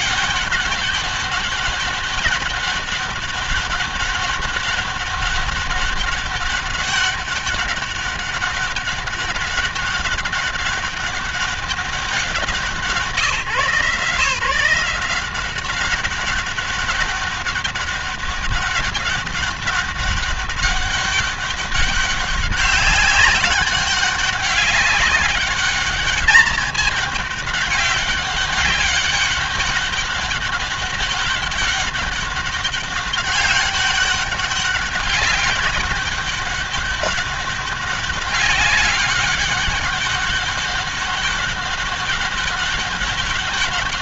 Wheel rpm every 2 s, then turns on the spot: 200, 200, 200, 200, 200, 200, 180, 170, 200, 200, 200, 200, 200, 200, 190, 200, 200, 200, 200, 200, 200, 200.
none